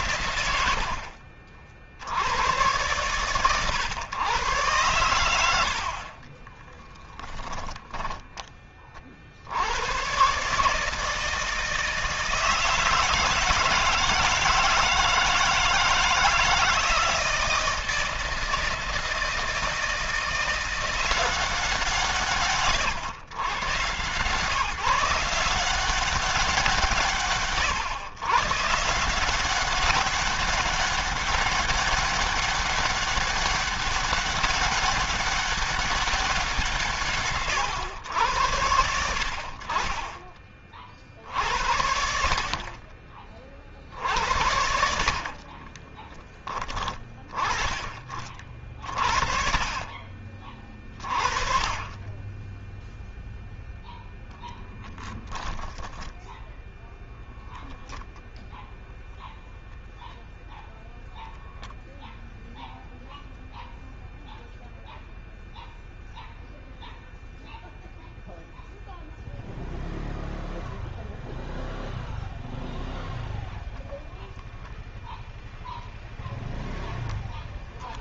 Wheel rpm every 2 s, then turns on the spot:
70, 110, 100, 10, 30, 150, 160, 160, 160, 160, 180, 130, 160, 150, 160, 200, 200, 200, 150, 70, 50, 40, 60, 20, 50, 30, 0, 20, 0, 0, 0, 0, 0, 0, 0, 0, 0, 0, 0.
44-46 54-56